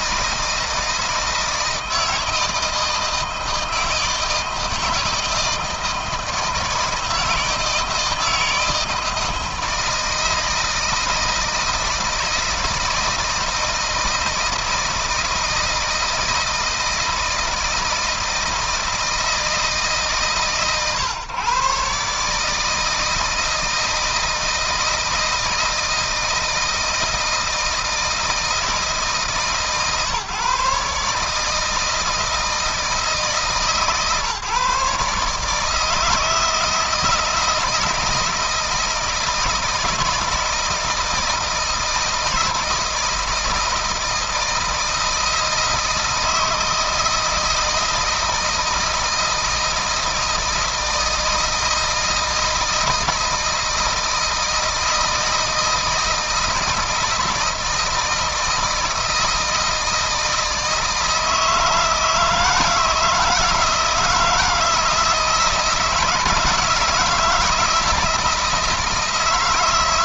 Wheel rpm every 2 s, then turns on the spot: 160, 160, 160, 160, 160, 160, 160, 160, 160, 160, 140, 160, 160, 160, 160, 150, 160, 140, 160, 160, 160, 160, 160, 160, 160, 160, 160, 160, 160, 160, 160, 160, 160, 160, 160.
none